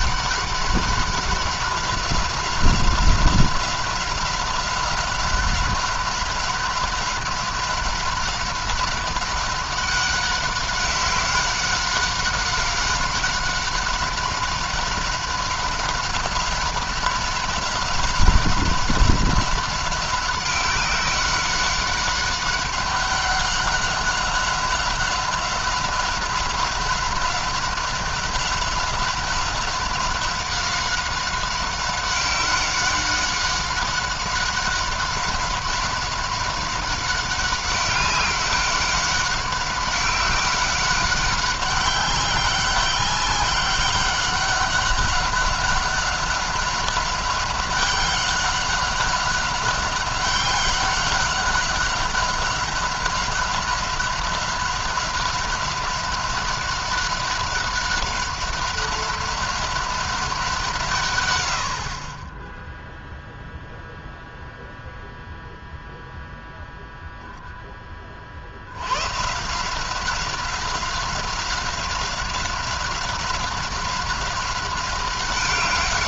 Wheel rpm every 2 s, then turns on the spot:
190, 190, 190, 190, 190, 190, 190, 190, 190, 190, 190, 200, 190, 190, 190, 190, 190, 190, 190, 200, 190, 190, 190, 190, 200, 190, 190, 190, 190, 190, 170, 10, 0, 0, 80, 190, 190, 190.
none